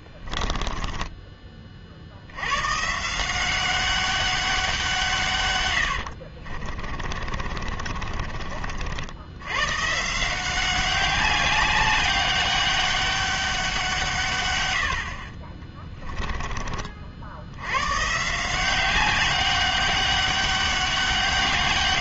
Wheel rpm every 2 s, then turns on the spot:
10, 110, 180, 40, 50, 180, 200, 100, 30, 180, 200.
0-2 6-8